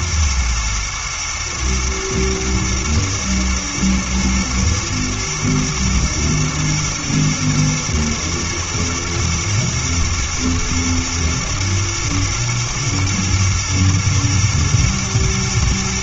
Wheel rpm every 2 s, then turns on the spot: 110, 110, 120, 110, 110, 110, 120, 120.
none